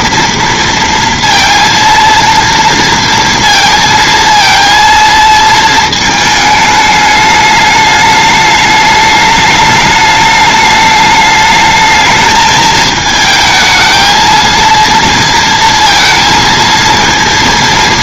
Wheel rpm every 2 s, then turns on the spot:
230, 230, 230, 210, 210, 210, 220, 230, 230.
none